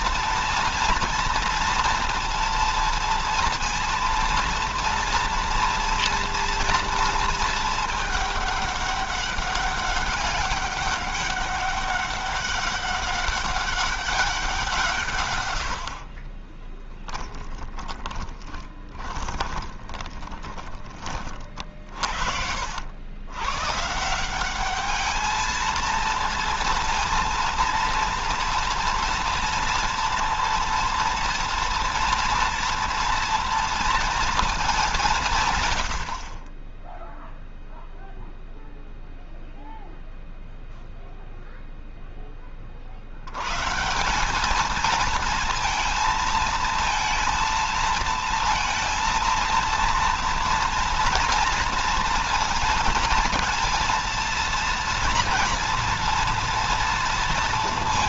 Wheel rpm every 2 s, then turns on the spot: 230, 230, 230, 230, 200, 190, 200, 170, 20, 20, 30, 80, 200, 230, 230, 230, 230, 200, 20, 0, 0, 40, 220, 230, 230, 230, 230, 230, 230.
16-20